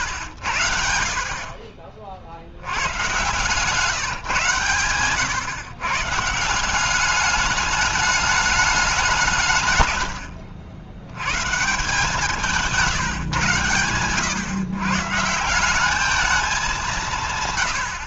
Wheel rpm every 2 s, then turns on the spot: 90, 80, 120, 170, 210, 80, 170, 120, 190.
none